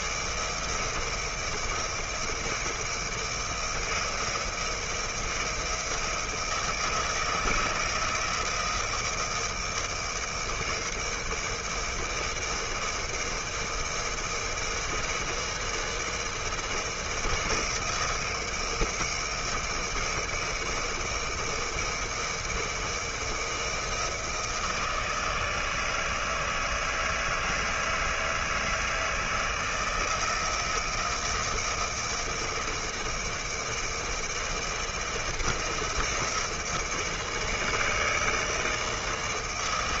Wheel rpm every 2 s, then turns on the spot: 160, 160, 170, 160, 160, 160, 160, 160, 160, 160, 160, 160, 160, 160, 160, 160, 160, 170, 160, 160.
none